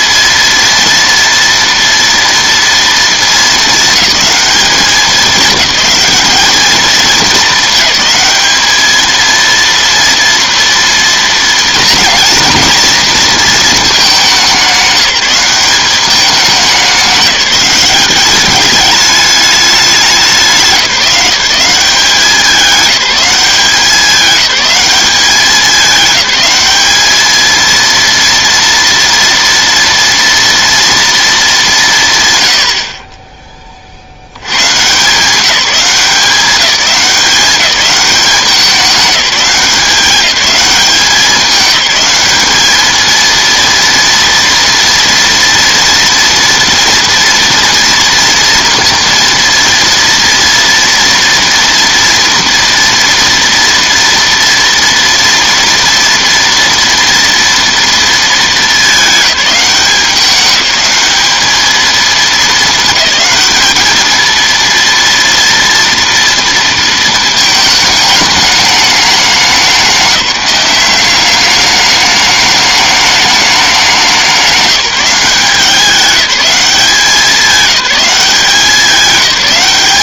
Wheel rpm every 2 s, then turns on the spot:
230, 230, 210, 220, 220, 230, 230, 190, 190, 200, 170, 200, 200, 200, 230, 230, 70, 140, 190, 190, 200, 210, 230, 230, 230, 230, 230, 230, 240, 210, 190, 220, 230, 230, 210, 190, 210, 190, 190, 190.
none